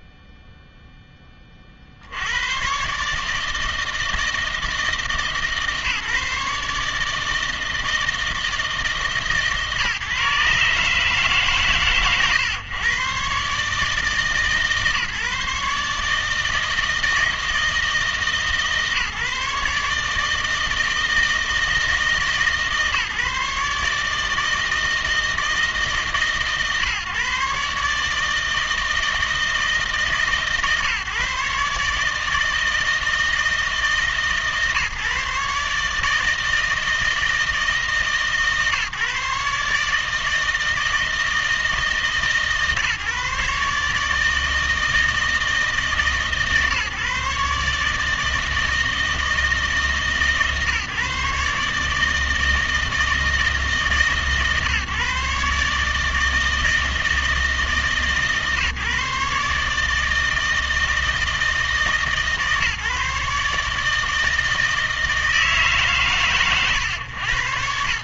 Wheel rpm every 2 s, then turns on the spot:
0, 110, 160, 150, 160, 150, 130, 140, 160, 160, 160, 150, 160, 140, 160, 140, 160, 140, 160, 140, 160, 140, 160, 140, 160, 140, 160, 140, 160, 150, 160, 140, 160, 130.
none